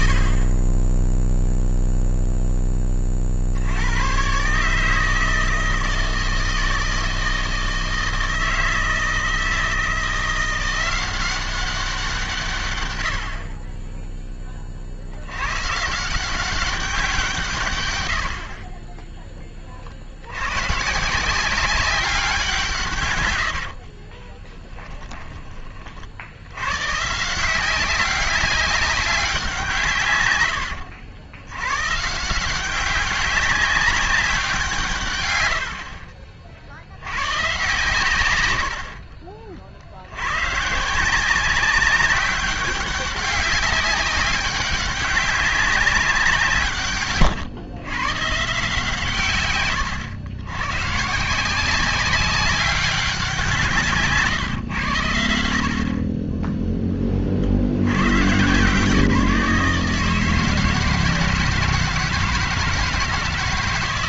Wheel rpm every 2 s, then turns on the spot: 30, 10, 150, 160, 160, 180, 120, 30, 190, 40, 130, 160, 10, 110, 200, 100, 180, 170, 50, 90, 140, 190, 200, 140, 150, 120, 190, 110, 10, 150, 160, 160.
24-26 30-32